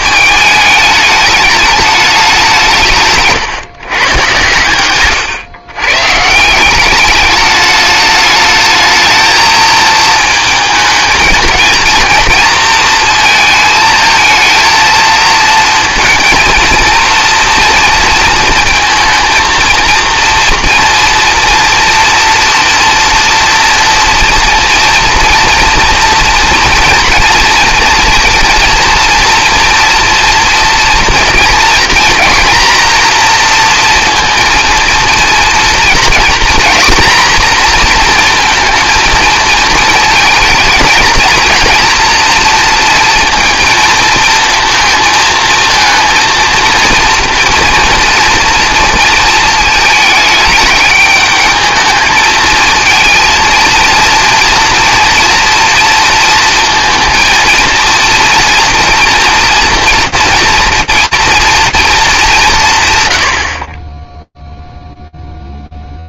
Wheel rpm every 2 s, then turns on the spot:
220, 170, 120, 180, 220, 220, 230, 230, 230, 230, 230, 230, 240, 240, 230, 240, 240, 230, 240, 230, 220, 230, 230, 230, 230, 210, 220, 230, 230, 240, 230, 200, 0.
4-6